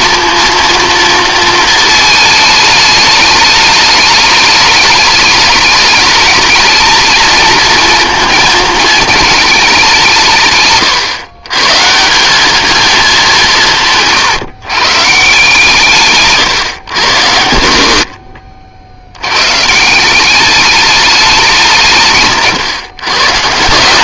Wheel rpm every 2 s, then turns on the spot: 230, 210, 210, 230, 220, 140, 210, 140, 120, 60, 210, 140.
none